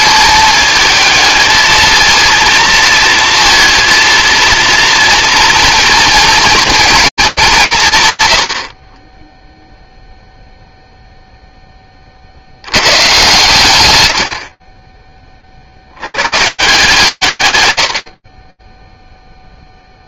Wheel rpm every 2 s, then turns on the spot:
220, 230, 230, 230, 50, 0, 80, 50, 150, 0.
none